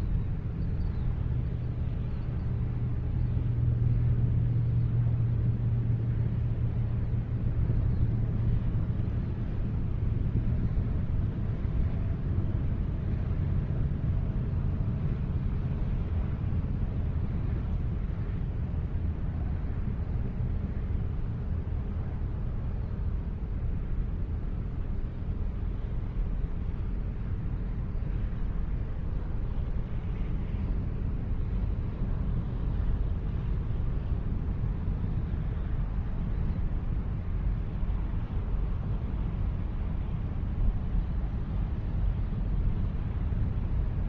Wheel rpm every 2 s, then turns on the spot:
0, 0, 0, 0, 0, 0, 0, 0, 0, 0, 0, 0, 0, 0, 0, 0, 0, 0, 0, 0, 0, 0.
none